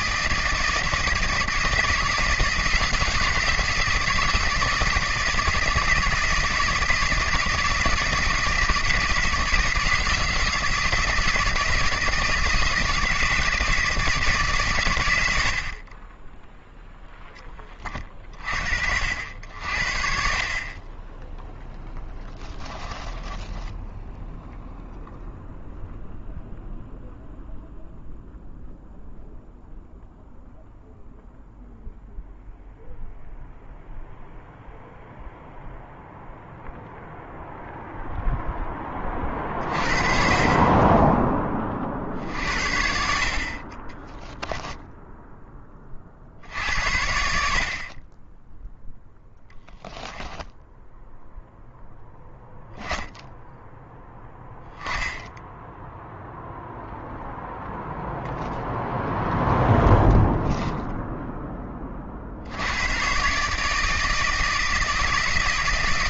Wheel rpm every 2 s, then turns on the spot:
160, 170, 170, 170, 160, 160, 160, 120, 0, 60, 30, 10, 0, 0, 0, 0, 0, 0, 0, 10, 20, 60, 10, 70, 0, 0, 10, 10, 0, 0, 0, 90, 160.
22-24